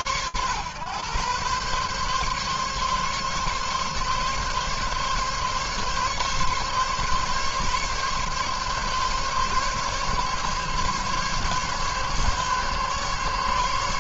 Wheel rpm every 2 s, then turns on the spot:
130, 140, 140, 140, 140, 140, 140.
none